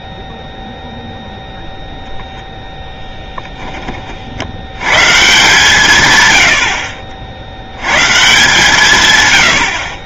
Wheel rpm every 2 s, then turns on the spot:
0, 10, 110, 70, 140.
none